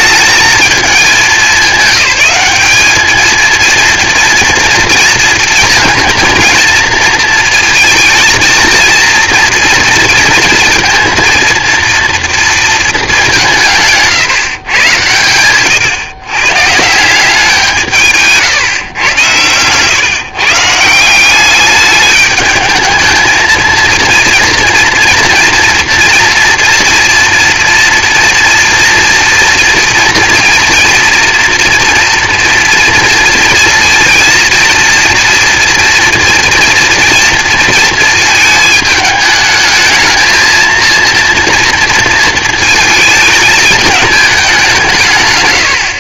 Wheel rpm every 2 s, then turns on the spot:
220, 210, 230, 220, 230, 230, 220, 120, 140, 130, 150, 210, 230, 230, 240, 230, 230, 230, 230, 220, 230, 220, 180.
none